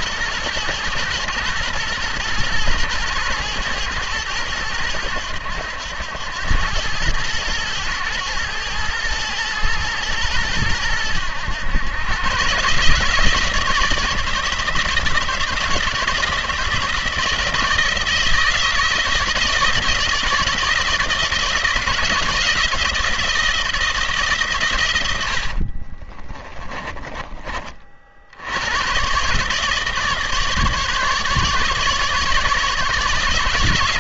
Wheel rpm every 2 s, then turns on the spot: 120, 120, 110, 100, 110, 110, 140, 160, 160, 160, 160, 170, 120, 20, 100, 150, 150.
24-28